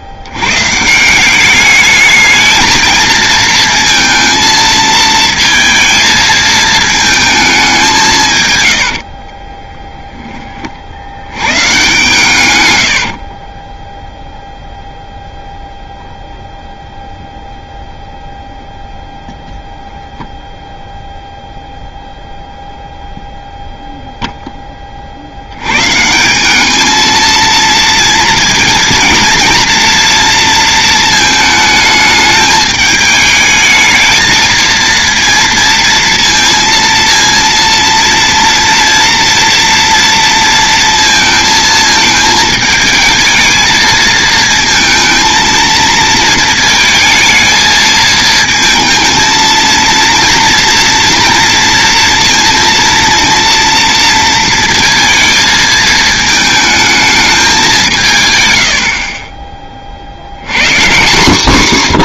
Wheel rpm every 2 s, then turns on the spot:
130, 220, 230, 220, 120, 40, 90, 0, 0, 0, 0, 0, 20, 210, 230, 230, 210, 230, 230, 230, 230, 220, 220, 220, 230, 230, 230, 220, 220, 90, 140.
12-14